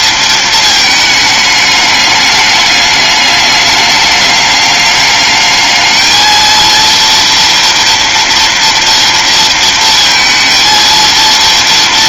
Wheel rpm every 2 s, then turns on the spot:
210, 210, 210, 230, 230, 230.
none